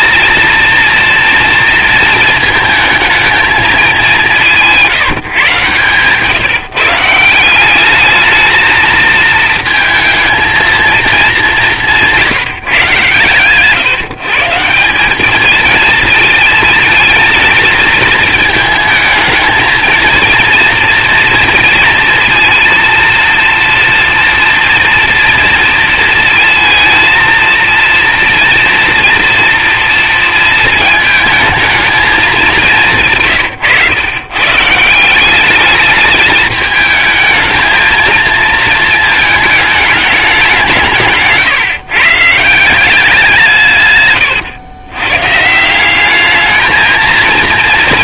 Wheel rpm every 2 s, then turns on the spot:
230, 220, 170, 160, 220, 230, 140, 170, 220, 220, 230, 230, 230, 230, 230, 220, 180, 150, 220, 220, 170, 180, 110, 220.
none